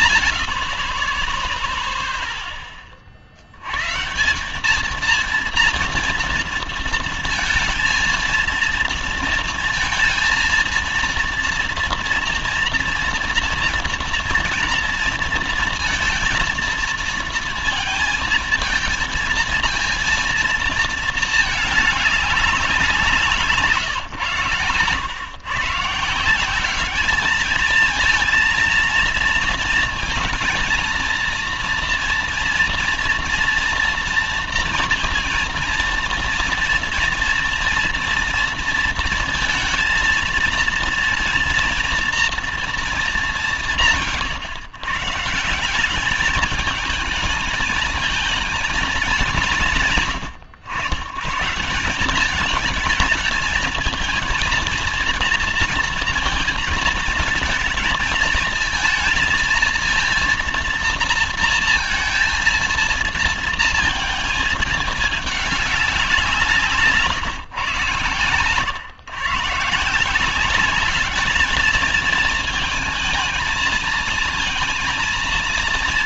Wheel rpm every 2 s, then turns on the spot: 80, 10, 190, 230, 230, 230, 230, 230, 230, 230, 230, 190, 120, 190, 230, 230, 230, 230, 230, 230, 230, 230, 130, 210, 220, 100, 210, 230, 230, 230, 230, 230, 220, 170, 120, 180, 220, 230.
none